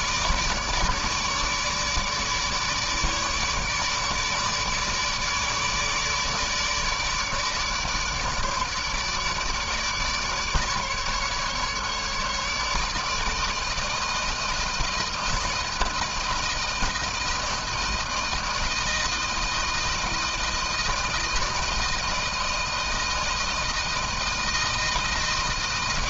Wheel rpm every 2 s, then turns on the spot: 150, 150, 150, 150, 150, 150, 150, 160, 160, 160, 160, 160, 160.
none